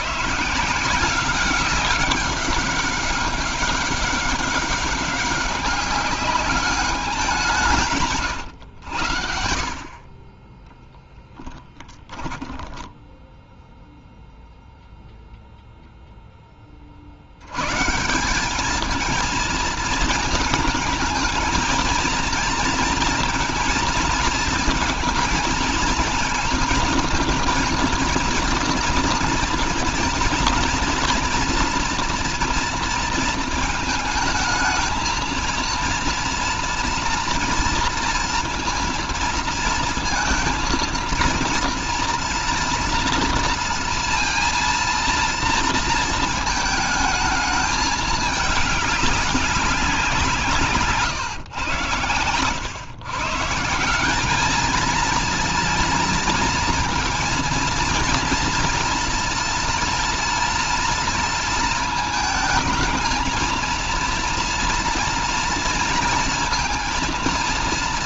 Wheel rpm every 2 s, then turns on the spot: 170, 200, 200, 200, 90, 10, 10, 0, 50, 210, 220, 230, 220, 230, 230, 240, 230, 220, 230, 230, 230, 230, 230, 220, 200, 150, 120, 220, 230, 230, 230, 220, 230, 230.
10-12